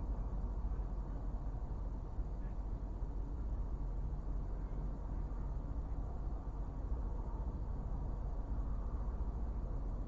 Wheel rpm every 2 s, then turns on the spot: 0, 0, 0, 0, 0.
none